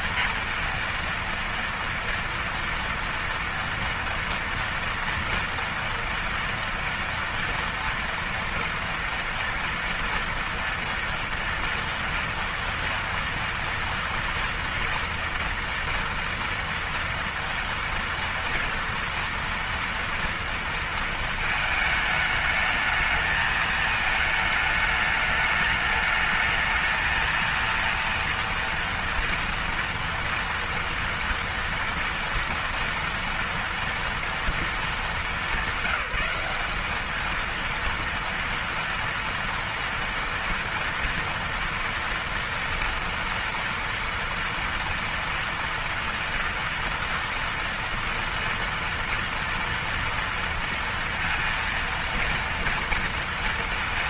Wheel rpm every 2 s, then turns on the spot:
230, 230, 230, 230, 230, 240, 230, 240, 230, 230, 230, 220, 220, 210, 230, 230, 240, 230, 200, 230, 240, 230, 230, 230, 230, 230, 230.
none